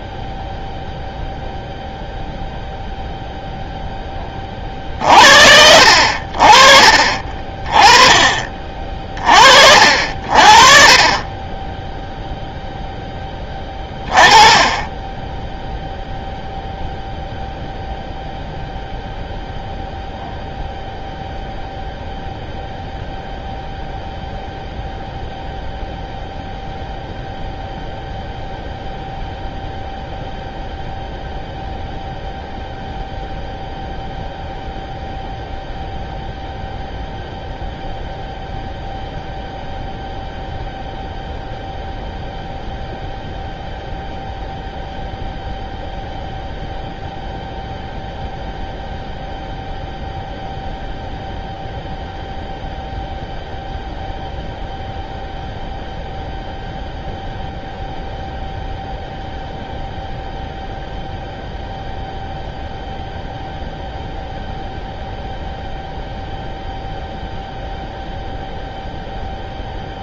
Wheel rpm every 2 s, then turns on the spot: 0, 0, 40, 40, 40, 40, 0, 20, 0, 0, 0, 0, 0, 0, 0, 0, 0, 0, 0, 0, 0, 0, 0, 0, 0, 0, 0, 0, 0, 0, 0, 0, 0, 0, 0.
none